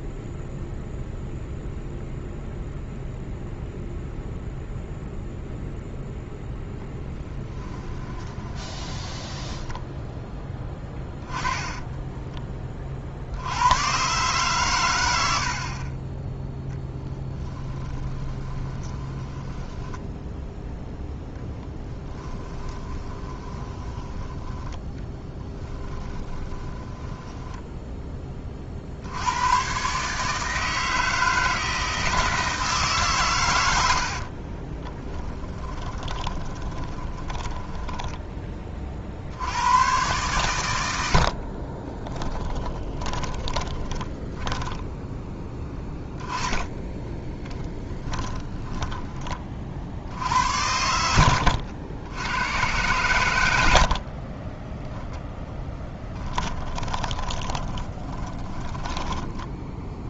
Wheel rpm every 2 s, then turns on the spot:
0, 0, 0, 0, 20, 10, 30, 110, 20, 20, 0, 20, 10, 20, 50, 160, 150, 10, 20, 30, 90, 20, 10, 10, 20, 80, 110, 10, 20, 10.
8-10 16-20 22-24 26-28 34-38 42-50 56-60